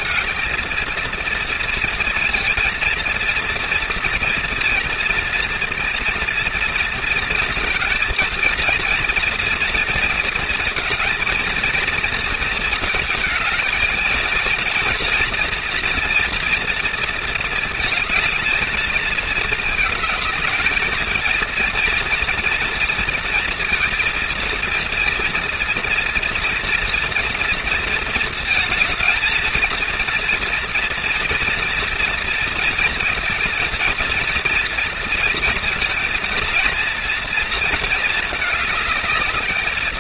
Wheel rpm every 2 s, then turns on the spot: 220, 230, 230, 230, 230, 230, 230, 230, 230, 230, 220, 230, 230, 230, 230, 230, 230, 230, 230, 220.
none